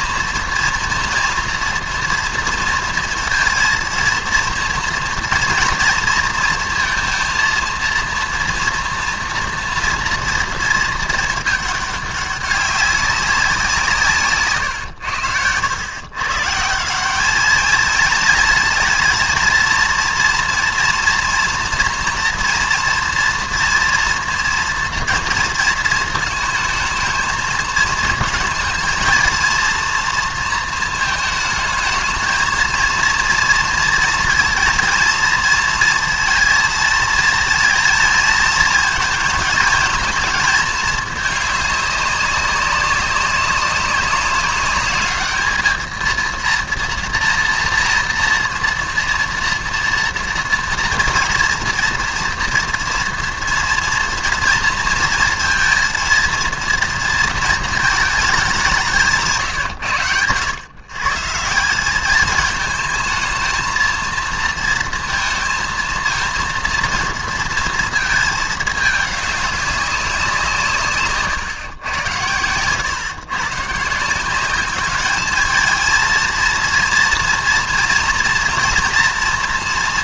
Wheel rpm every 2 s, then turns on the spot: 230, 230, 230, 230, 230, 230, 210, 160, 120, 220, 230, 230, 230, 230, 220, 230, 220, 230, 230, 220, 230, 200, 200, 220, 230, 240, 230, 230, 230, 220, 100, 200, 230, 230, 230, 190, 100, 160, 230, 240.
none